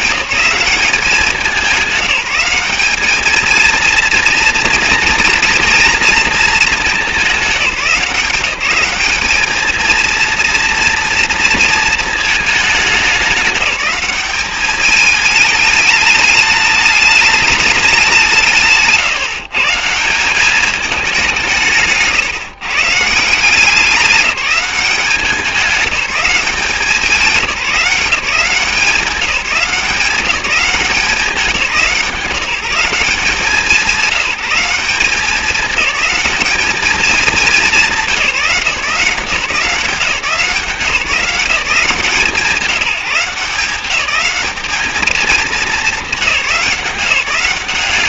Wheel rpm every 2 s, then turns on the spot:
200, 200, 230, 230, 190, 230, 210, 210, 210, 160, 200, 150, 200, 190, 180, 180, 180, 180, 210, 180, 180, 180, 210, 200.
none